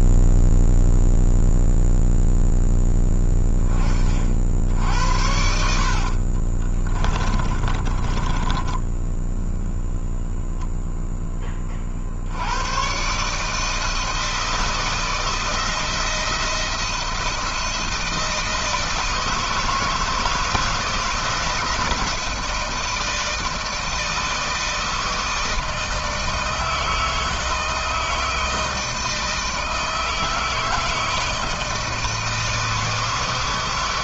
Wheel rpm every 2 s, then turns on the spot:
0, 0, 60, 30, 10, 0, 110, 160, 170, 160, 160, 160, 160, 160, 160, 160, 160.
6-8